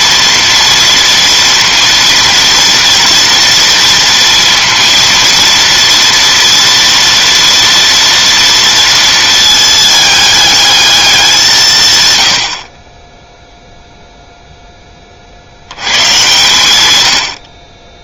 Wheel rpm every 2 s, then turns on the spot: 230, 240, 230, 240, 230, 210, 20, 10, 110.
none